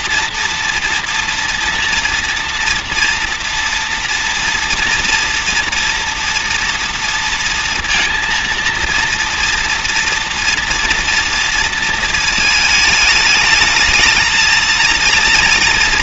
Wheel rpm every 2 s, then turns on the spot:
240, 230, 230, 230, 240, 230, 220, 220.
none